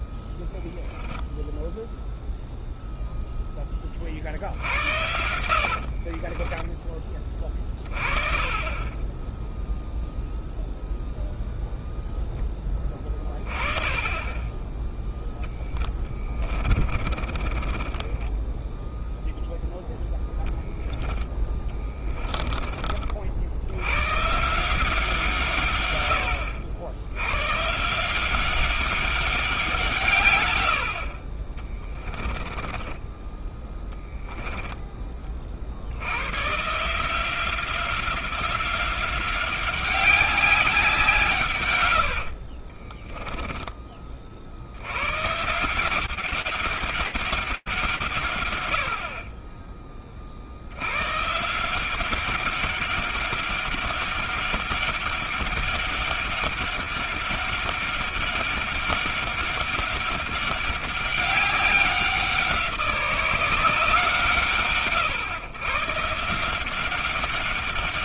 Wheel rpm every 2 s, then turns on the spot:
20, 0, 70, 20, 20, 0, 10, 10, 30, 10, 10, 40, 160, 80, 190, 90, 10, 10, 150, 190, 180, 30, 70, 190, 90, 90, 200, 200, 200, 200, 200, 180, 130, 200.
4-8 16-20 32-34 42-44